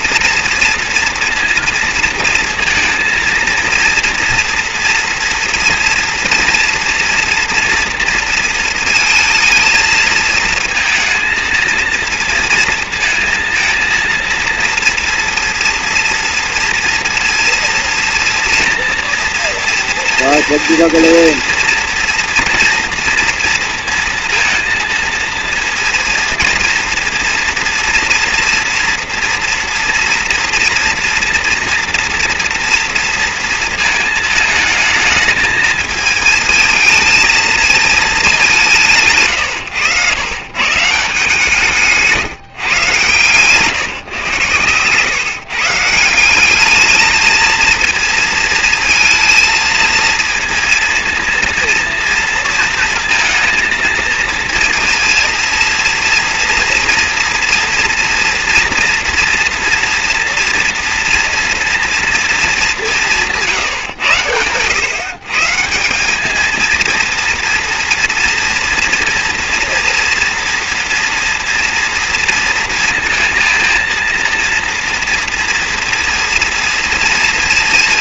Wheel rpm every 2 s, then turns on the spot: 230, 230, 230, 240, 220, 230, 230, 230, 230, 240, 230, 230, 230, 230, 230, 230, 230, 220, 220, 130, 160, 130, 140, 220, 230, 230, 230, 230, 240, 240, 230, 160, 140, 230, 230, 230, 230, 230, 230.
42-44